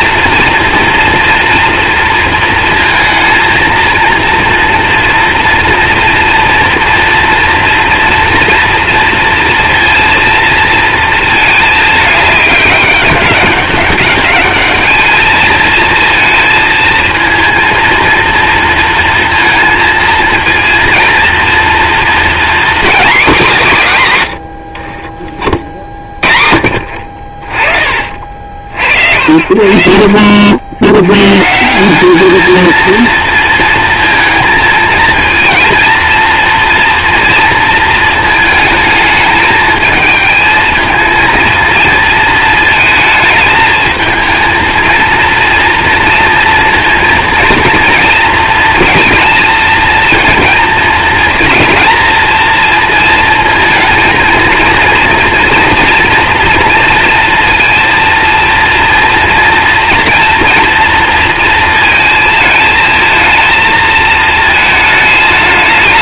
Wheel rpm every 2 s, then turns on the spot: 230, 230, 240, 230, 230, 220, 200, 220, 230, 230, 230, 240, 40, 60, 70, 100, 230, 230, 230, 220, 220, 220, 230, 230, 230, 230, 230, 230, 230, 230, 230, 220, 220.
24-26